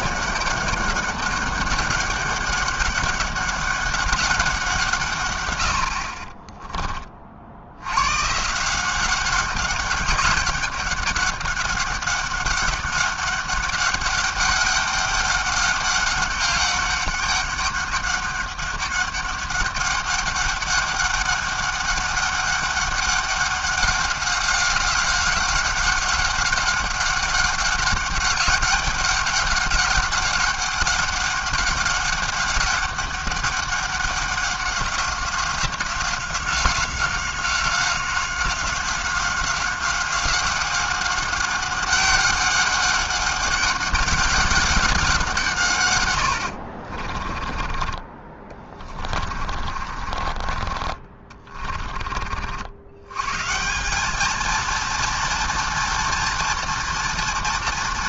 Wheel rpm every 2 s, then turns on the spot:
200, 200, 170, 20, 170, 190, 200, 200, 200, 200, 200, 200, 190, 200, 190, 190, 200, 190, 190, 190, 190, 200, 190, 50, 40, 30, 90, 230, 230.
46-50